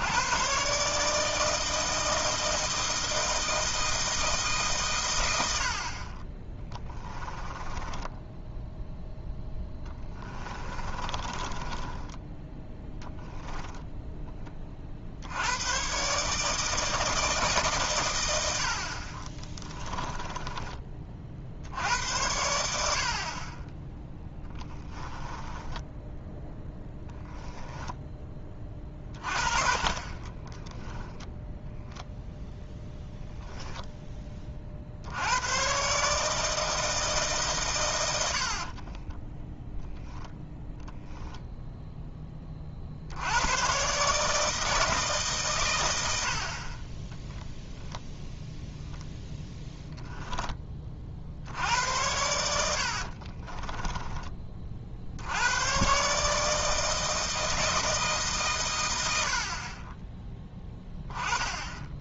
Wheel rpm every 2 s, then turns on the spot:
140, 160, 120, 20, 0, 20, 0, 50, 160, 50, 30, 70, 10, 0, 40, 10, 0, 60, 160, 30, 10, 60, 160, 30, 0, 30, 60, 50, 160, 100, 10.
6-8 10-12 24-26 30-32 38-40 52-54